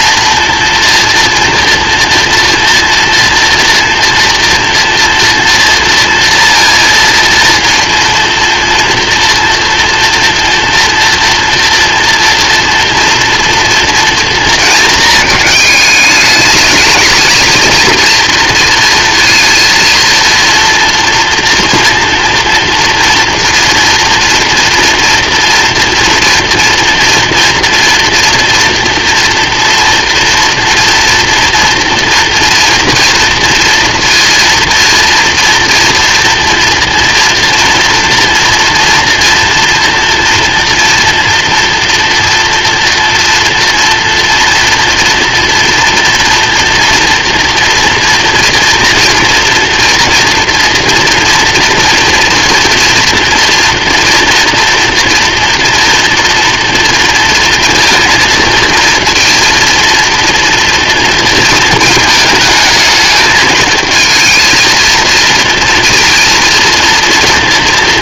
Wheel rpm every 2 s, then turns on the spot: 230, 240, 230, 230, 230, 240, 230, 230, 210, 230, 230, 230, 230, 230, 240, 230, 230, 230, 240, 230, 230, 230, 230, 230, 230, 230, 230, 230, 230, 230, 230, 220, 220, 230.
none